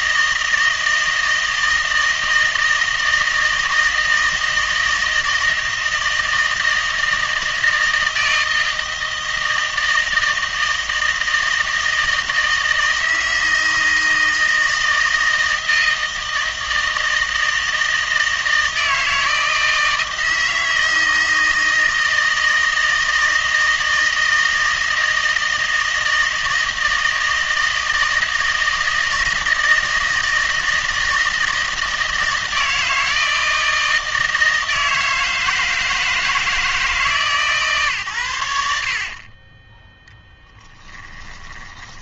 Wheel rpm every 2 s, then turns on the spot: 160, 160, 160, 160, 160, 160, 160, 160, 160, 160, 160, 160, 160, 160, 160, 160, 160, 160, 160, 70, 20.
38-42